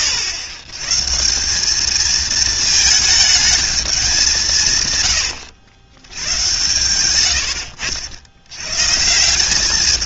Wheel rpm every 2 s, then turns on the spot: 110, 220, 140, 100, 140.
none